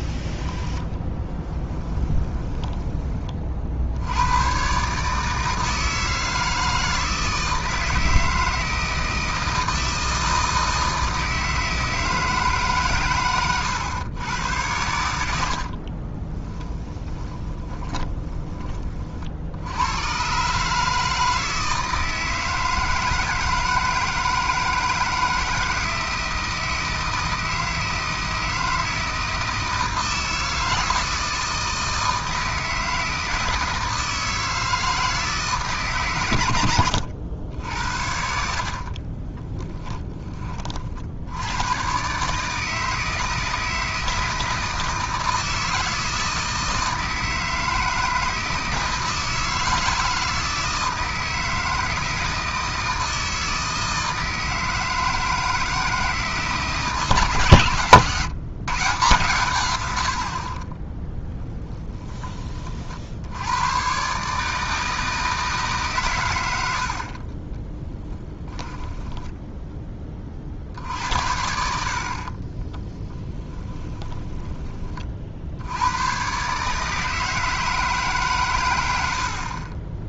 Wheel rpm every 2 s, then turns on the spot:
30, 20, 140, 160, 160, 160, 140, 90, 10, 30, 150, 160, 160, 160, 160, 160, 160, 160, 90, 40, 50, 160, 160, 160, 160, 160, 160, 160, 160, 150, 20, 60, 160, 70, 10, 70, 10, 30, 150, 100.
0-2 16-18 38-40 60-62 66-70 72-74